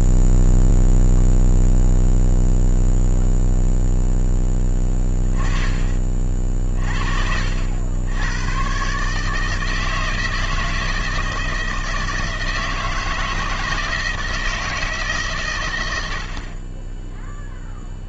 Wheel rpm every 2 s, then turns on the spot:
0, 0, 10, 40, 110, 160, 160, 160, 110.
none